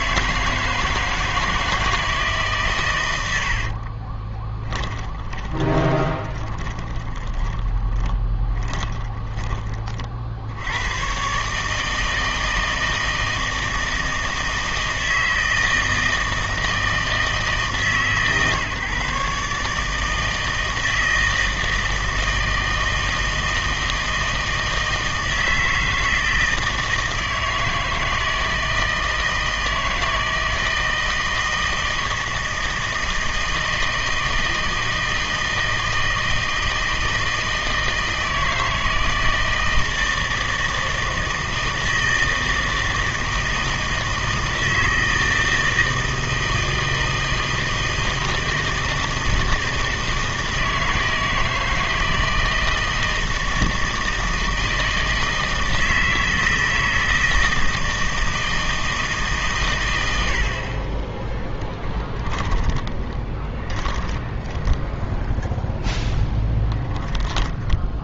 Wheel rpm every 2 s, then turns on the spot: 160, 140, 20, 20, 10, 90, 160, 160, 160, 140, 160, 160, 160, 160, 160, 160, 160, 160, 160, 160, 160, 160, 160, 160, 160, 160, 160, 160, 160, 160, 50, 20, 10, 10.
4-10 62-68